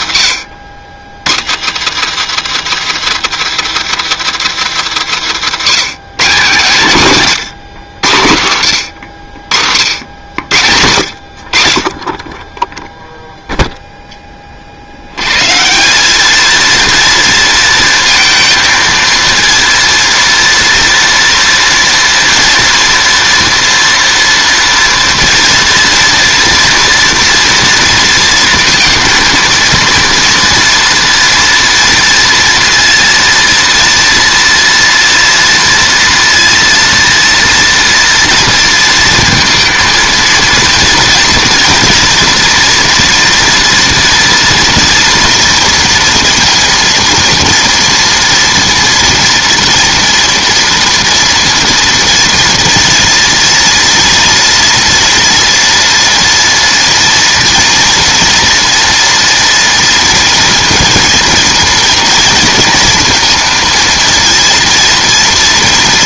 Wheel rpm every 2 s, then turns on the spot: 80, 170, 160, 160, 100, 90, 10, 40, 220, 220, 230, 230, 230, 240, 230, 230, 230, 230, 230, 230, 230, 230, 230, 230, 240, 230, 230, 230, 230, 230, 230, 230, 230.
none